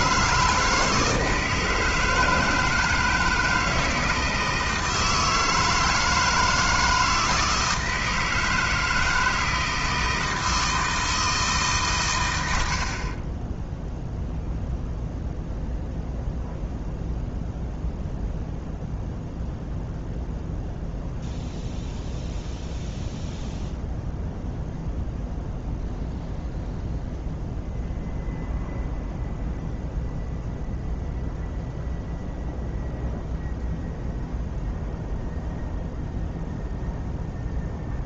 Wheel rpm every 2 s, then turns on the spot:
160, 160, 160, 160, 160, 160, 50, 0, 0, 0, 0, 0, 0, 0, 0, 0, 0, 0, 0.
12-14